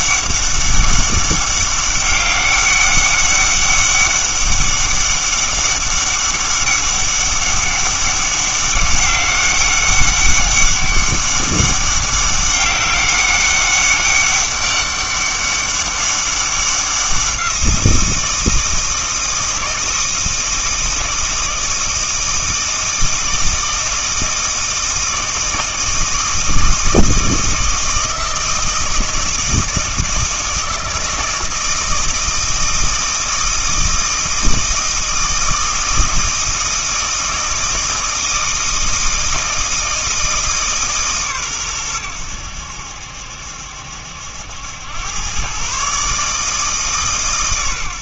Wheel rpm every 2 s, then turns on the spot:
200, 200, 200, 200, 200, 200, 200, 200, 190, 160, 160, 160, 160, 160, 160, 160, 160, 160, 160, 160, 150, 80, 90, 150.
none